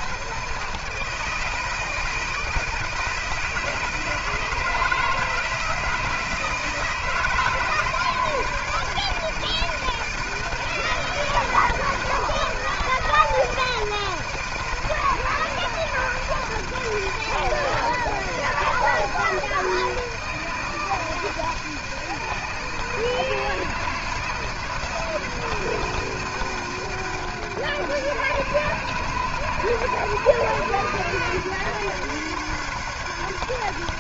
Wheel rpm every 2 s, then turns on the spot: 160, 160, 160, 160, 150, 160, 170, 160, 160, 170, 160, 160, 160, 160, 150, 150, 150.
none